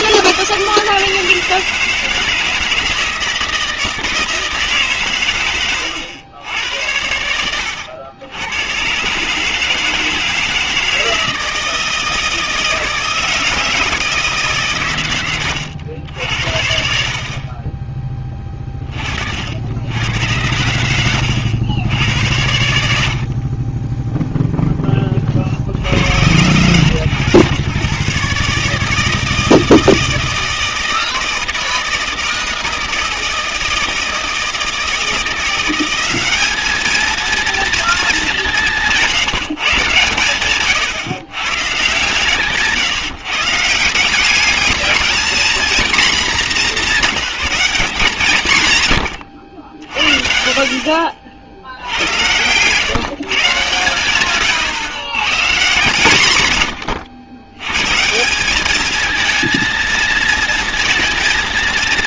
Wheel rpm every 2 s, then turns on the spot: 160, 160, 140, 90, 130, 160, 160, 130, 60, 40, 100, 70, 10, 100, 150, 160, 160, 160, 210, 170, 130, 140, 210, 210, 120, 50, 130, 130, 110, 210, 230.
40-42